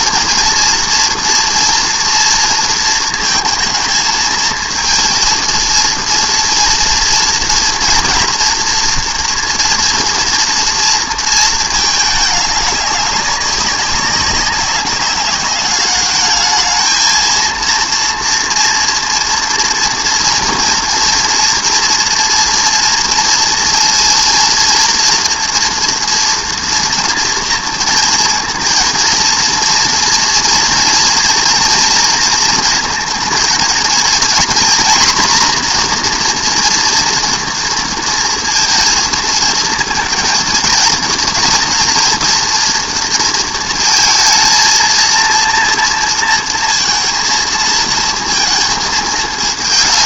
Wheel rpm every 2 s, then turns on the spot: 230, 230, 230, 230, 240, 230, 200, 200, 220, 230, 230, 230, 230, 230, 230, 230, 220, 240, 240, 230, 230, 230, 230, 230, 230.
none